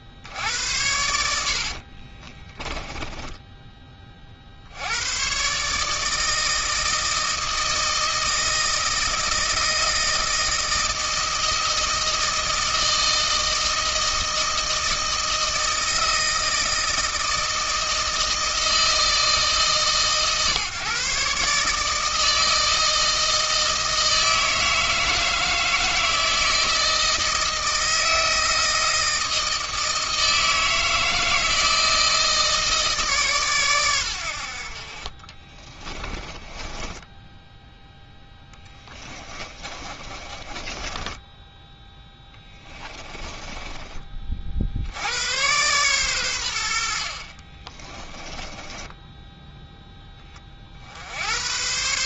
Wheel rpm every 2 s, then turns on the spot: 60, 20, 70, 160, 160, 160, 160, 160, 160, 160, 140, 160, 160, 160, 160, 160, 150, 50, 20, 20, 20, 10, 70, 70, 10, 70.
2-4 36-44 48-50